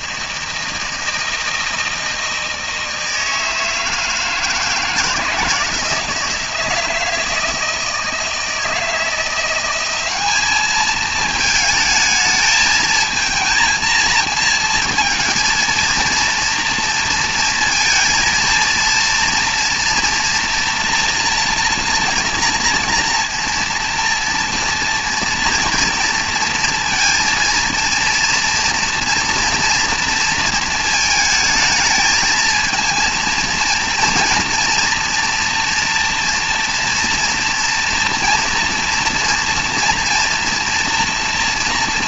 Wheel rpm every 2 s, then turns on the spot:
160, 160, 160, 170, 160, 210, 220, 220, 230, 230, 230, 230, 230, 230, 230, 230, 220, 240, 230, 230, 230.
none